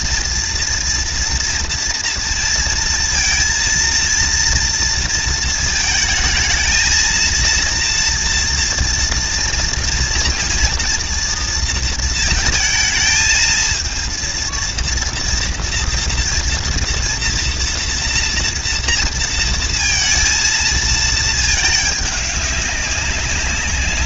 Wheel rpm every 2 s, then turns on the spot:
230, 230, 230, 220, 230, 240, 220, 230, 230, 240, 230, 200.
none